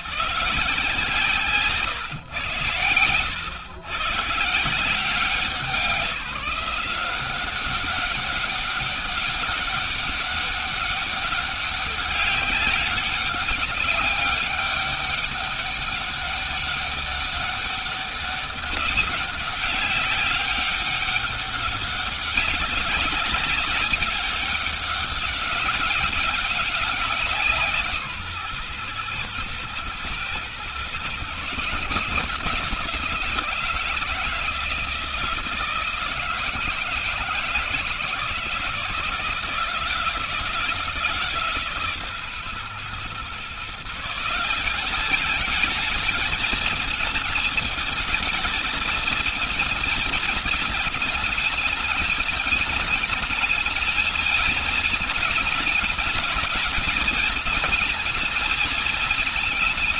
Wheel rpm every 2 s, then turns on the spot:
160, 120, 170, 180, 200, 200, 200, 200, 200, 200, 190, 190, 200, 190, 130, 120, 160, 160, 160, 160, 160, 130, 170, 220, 220, 220, 220, 220, 210, 220.
none